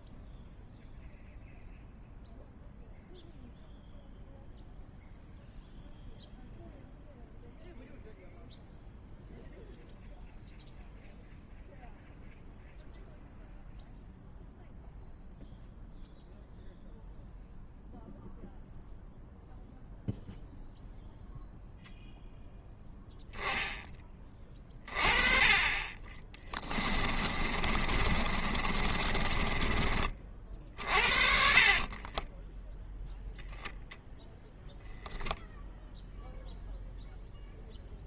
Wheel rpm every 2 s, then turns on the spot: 0, 0, 0, 0, 0, 0, 0, 0, 0, 0, 0, 0, 20, 20, 30, 50, 10, 0, 0.
26-30 32-34